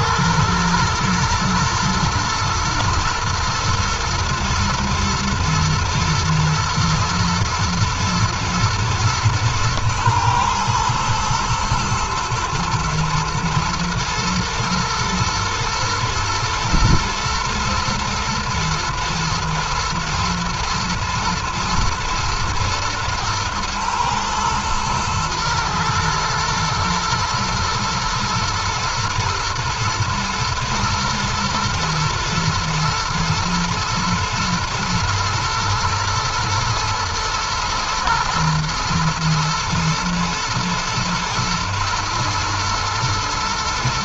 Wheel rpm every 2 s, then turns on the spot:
120, 120, 120, 120, 110, 120, 120, 110, 120, 110, 120, 110, 110, 120, 120, 120, 110, 110, 110, 120, 110, 110.
none